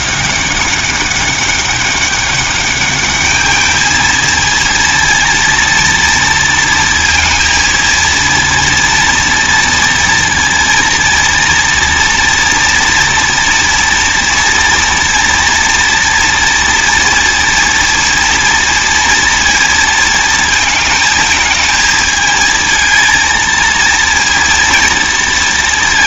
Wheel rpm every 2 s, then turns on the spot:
190, 200, 230, 230, 230, 230, 230, 230, 230, 230, 220, 220, 230.
none